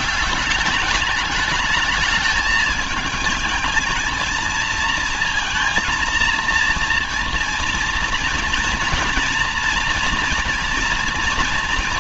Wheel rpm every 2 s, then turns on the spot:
200, 220, 230, 230, 230, 230.
none